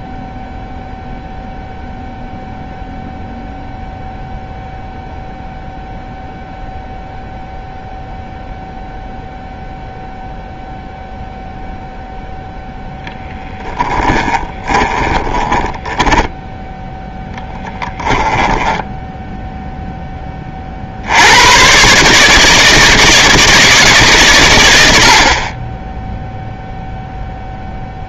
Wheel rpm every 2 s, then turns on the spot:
0, 0, 0, 0, 0, 0, 0, 30, 0, 10, 40, 160, 120, 0.
14-16 18-20